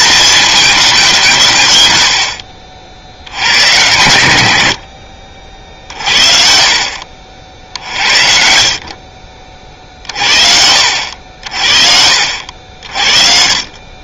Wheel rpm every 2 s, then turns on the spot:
180, 70, 70, 60, 50, 70, 50.
8-10